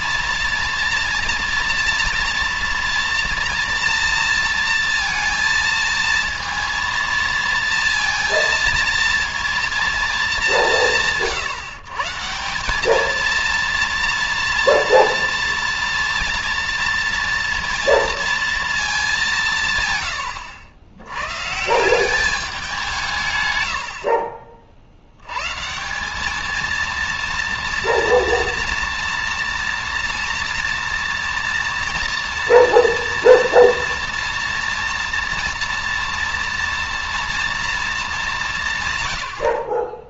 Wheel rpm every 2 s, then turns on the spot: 230, 240, 230, 230, 230, 210, 170, 230, 230, 230, 90, 200, 50, 210, 230, 230, 230, 230, 230, 180.
none